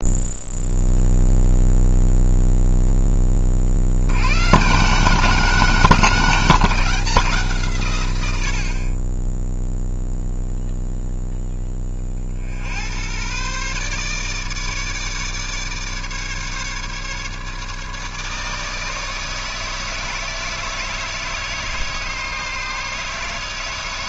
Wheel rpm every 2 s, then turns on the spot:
0, 0, 160, 180, 40, 0, 90, 150, 150, 160, 160, 150.
none